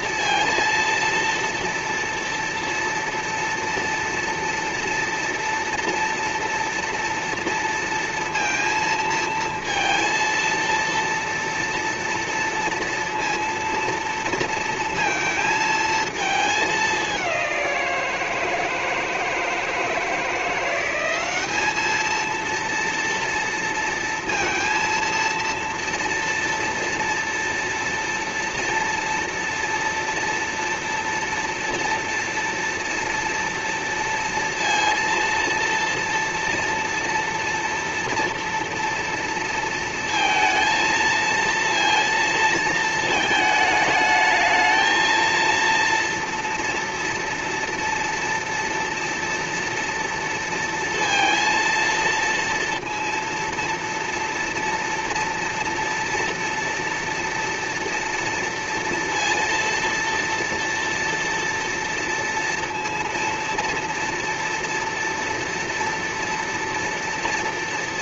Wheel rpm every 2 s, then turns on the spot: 230, 230, 230, 230, 230, 230, 230, 230, 220, 170, 160, 220, 230, 230, 230, 230, 240, 230, 230, 230, 230, 230, 220, 230, 230, 230, 230, 230, 230, 230, 230, 230, 230, 230.
none